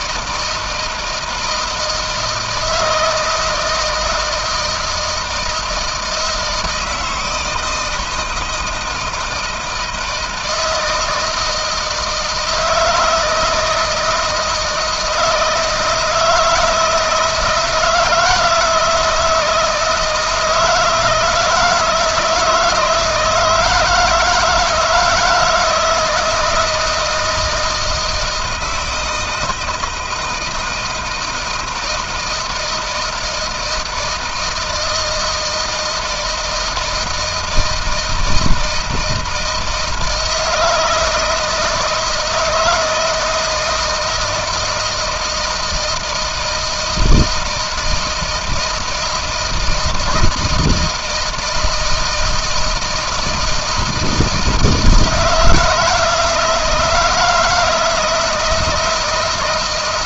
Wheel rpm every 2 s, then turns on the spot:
160, 160, 160, 160, 160, 160, 160, 160, 170, 160, 170, 160, 160, 160, 160, 170, 160, 160, 160, 160, 160, 160, 160, 160, 160, 160, 160, 160, 160, 160.
none